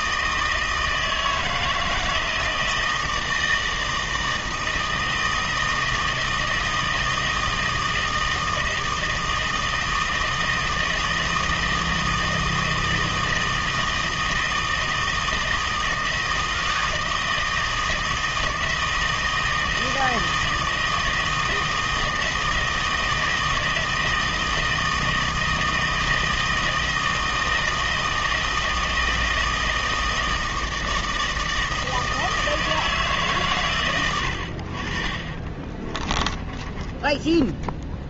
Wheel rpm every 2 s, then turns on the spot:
160, 160, 160, 160, 160, 160, 160, 160, 160, 160, 160, 160, 160, 160, 160, 160, 160, 70, 20.
34-38